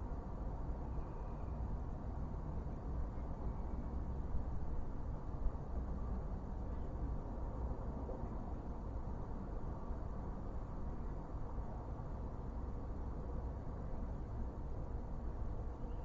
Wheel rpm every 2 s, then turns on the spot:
0, 0, 0, 0, 0, 0, 0, 0.
none